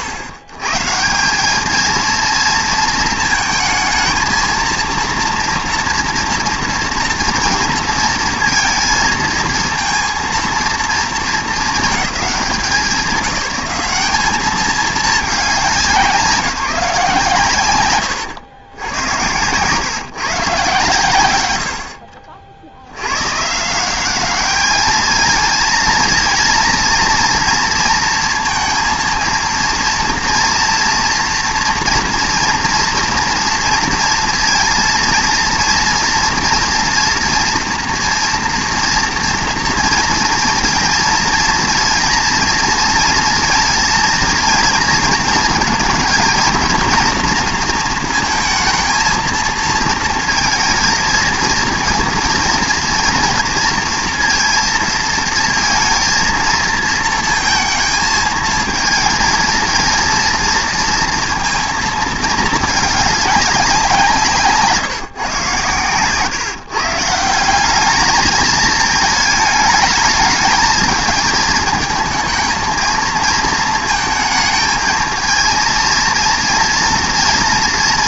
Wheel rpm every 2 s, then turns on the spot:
120, 230, 230, 230, 230, 230, 190, 220, 170, 100, 130, 60, 210, 230, 230, 230, 230, 230, 240, 230, 230, 230, 230, 240, 230, 220, 230, 230, 220, 220, 230, 220, 150, 140, 220, 220, 220, 220, 230.
none